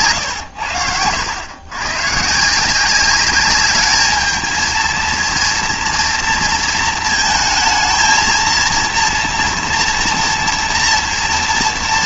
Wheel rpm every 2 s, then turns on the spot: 90, 170, 220, 230, 230, 230.
none